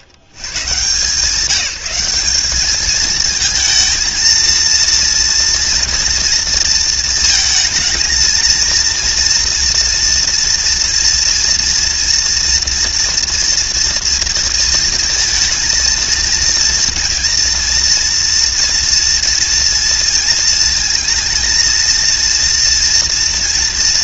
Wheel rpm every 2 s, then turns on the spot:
130, 200, 230, 230, 220, 230, 230, 230, 230, 230, 230, 240.
none